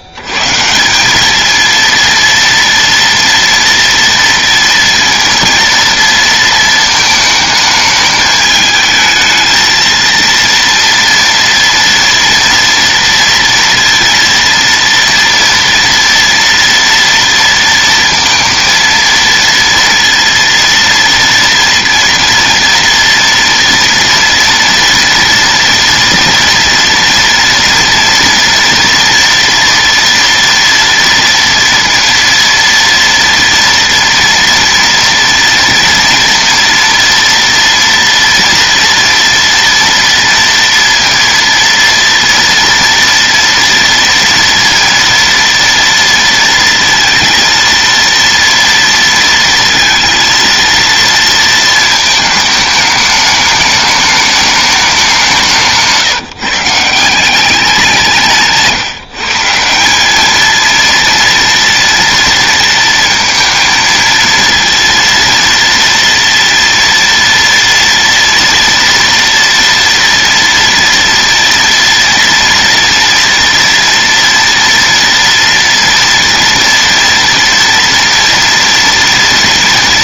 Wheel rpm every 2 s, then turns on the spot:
110, 230, 230, 230, 220, 230, 230, 230, 230, 230, 230, 230, 230, 230, 240, 230, 230, 230, 230, 240, 230, 230, 230, 230, 230, 230, 220, 210, 170, 170, 220, 230, 230, 230, 230, 230, 230, 230, 230, 230.
58-60